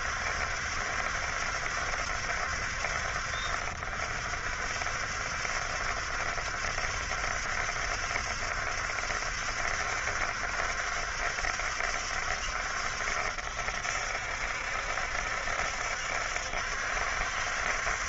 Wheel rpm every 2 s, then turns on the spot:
70, 70, 60, 70, 70, 70, 70, 70, 70.
none